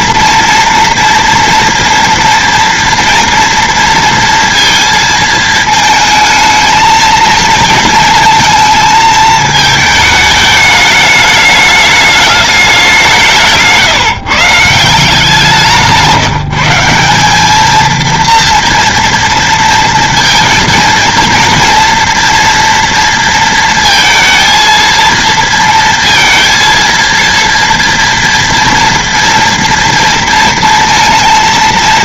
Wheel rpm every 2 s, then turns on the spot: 230, 230, 230, 220, 220, 210, 190, 160, 190, 230, 230, 230, 230, 230, 230, 230.
none